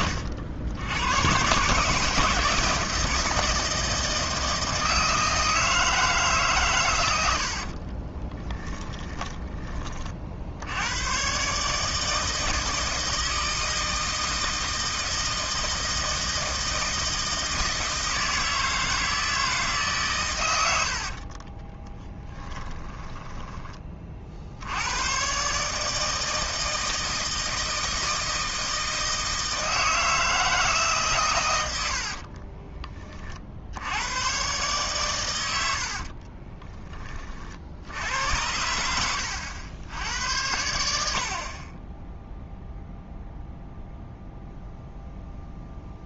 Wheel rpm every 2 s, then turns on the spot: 90, 160, 160, 120, 10, 80, 160, 160, 160, 160, 80, 10, 90, 160, 160, 150, 30, 120, 20, 80, 70, 0, 0.
8-10 20-24 38-40